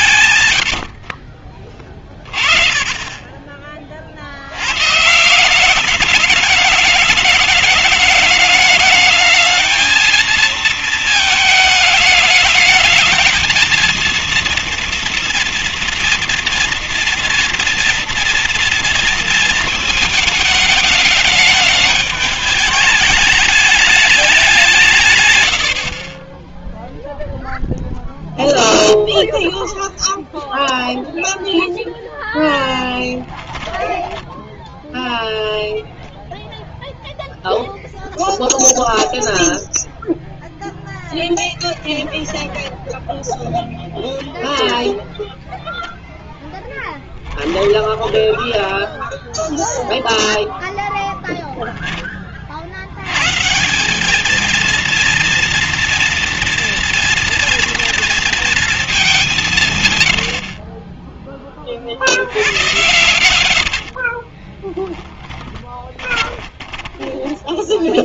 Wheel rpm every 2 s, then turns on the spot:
90, 30, 120, 210, 210, 220, 210, 230, 240, 230, 220, 210, 170, 0, 0, 0, 10, 0, 0, 0, 0, 0, 0, 10, 0, 0, 110, 230, 230, 210, 30, 100, 10, 20.
32-34 46-48 62-68